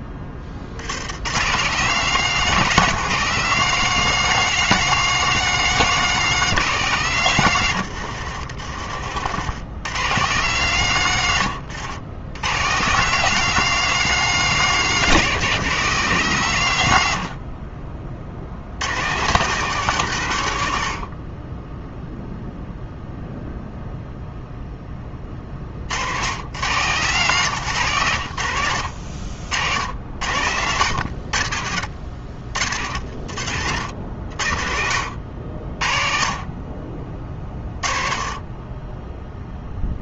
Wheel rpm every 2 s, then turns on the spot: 80, 200, 210, 190, 80, 140, 160, 200, 120, 110, 70, 0, 10, 140, 80, 90, 60, 70, 30, 20.
none